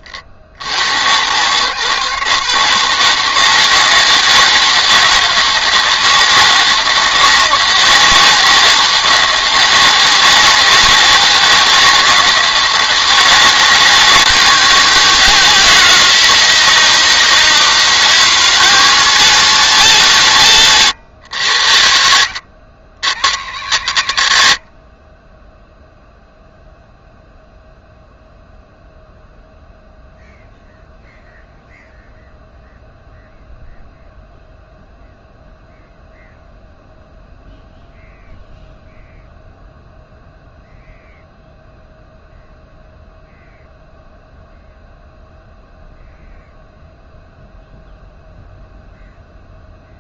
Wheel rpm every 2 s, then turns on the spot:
90, 160, 160, 170, 170, 170, 160, 160, 160, 200, 160, 120, 70, 0, 0, 0, 0, 0, 0, 0, 0, 0, 0, 0, 0.
20-22